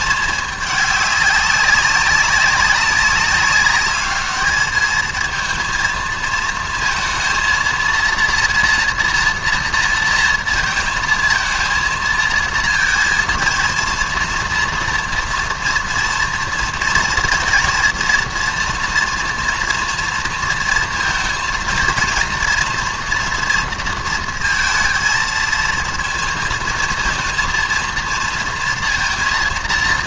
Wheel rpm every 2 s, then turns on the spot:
220, 190, 210, 230, 230, 230, 220, 230, 230, 230, 230, 230, 230, 230, 230.
none